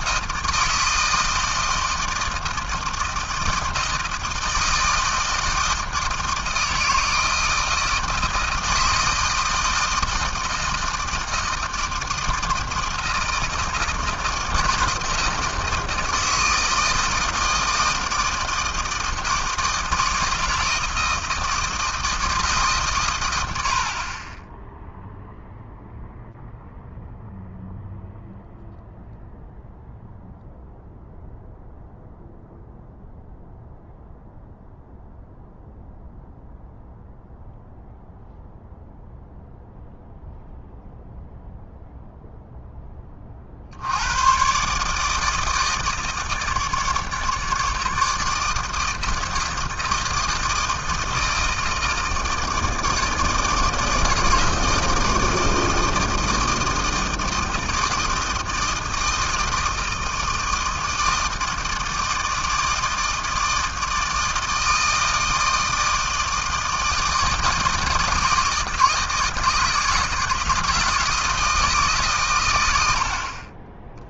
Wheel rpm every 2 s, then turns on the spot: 160, 160, 160, 160, 160, 160, 160, 160, 160, 160, 160, 150, 10, 0, 0, 0, 0, 0, 0, 0, 0, 0, 120, 160, 160, 160, 160, 160, 160, 160, 160, 160, 160, 160, 160, 160, 110.
none